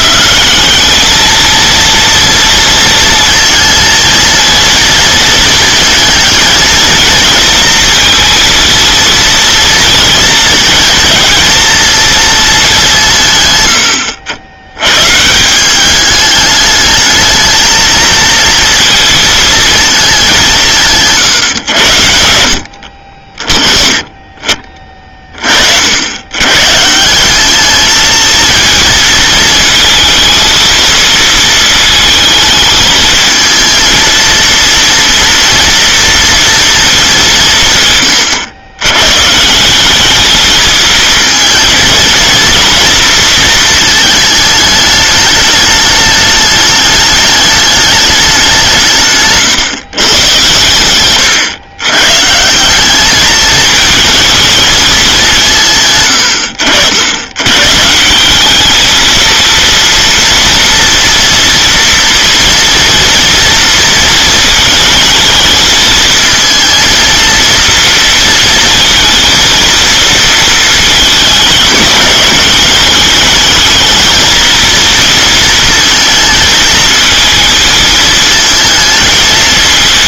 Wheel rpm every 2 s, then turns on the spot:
200, 230, 230, 230, 230, 220, 180, 110, 210, 230, 150, 70, 30, 140, 230, 230, 220, 230, 230, 100, 220, 230, 210, 210, 180, 110, 170, 220, 70, 210, 230, 230, 220, 230, 230, 230, 210, 230, 230, 220.
none